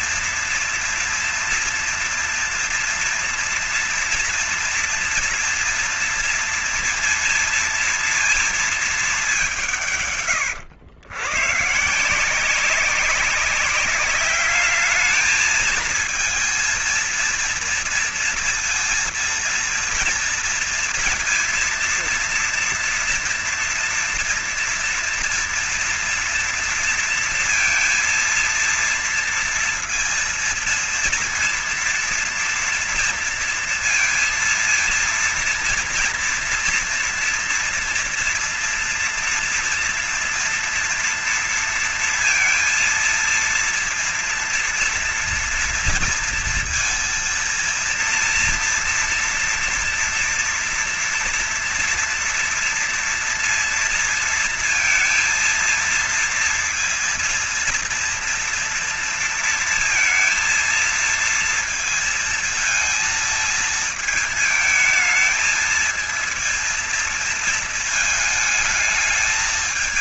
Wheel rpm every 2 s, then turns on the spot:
230, 230, 230, 230, 220, 120, 190, 210, 230, 230, 230, 230, 240, 230, 230, 230, 230, 230, 230, 230, 230, 230, 240, 230, 240, 230, 230, 230, 230, 230, 230, 230, 220, 230, 220.
none